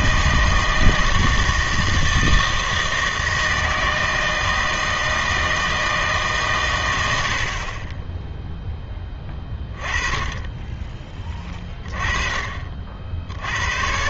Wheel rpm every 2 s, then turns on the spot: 160, 160, 160, 130, 10, 20, 50.
none